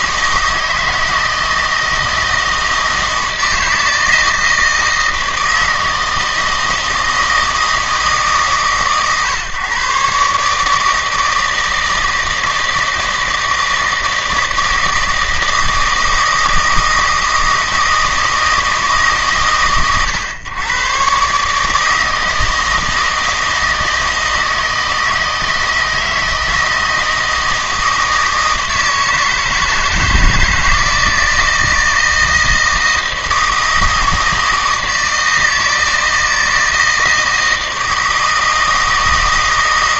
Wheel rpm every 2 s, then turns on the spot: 160, 160, 160, 160, 140, 150, 160, 160, 160, 160, 120, 160, 160, 160, 160, 160, 160, 160, 160, 160.
none